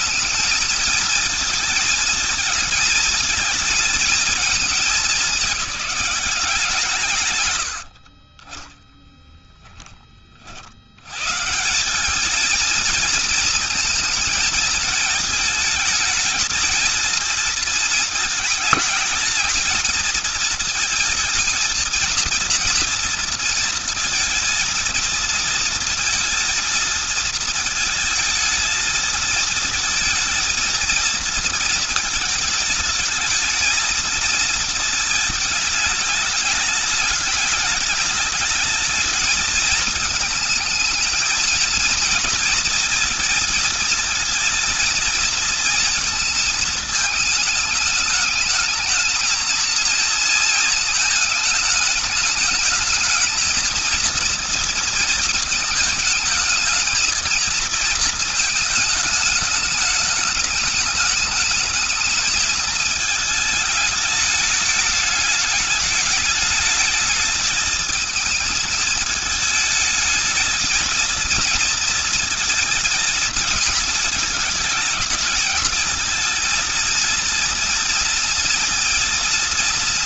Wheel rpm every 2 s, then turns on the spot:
220, 230, 220, 180, 40, 60, 220, 230, 220, 220, 230, 230, 230, 230, 220, 230, 220, 230, 210, 210, 220, 220, 230, 220, 210, 220, 210, 230, 220, 220, 210, 220, 210, 210, 220, 220, 220, 220, 230, 240.
8-10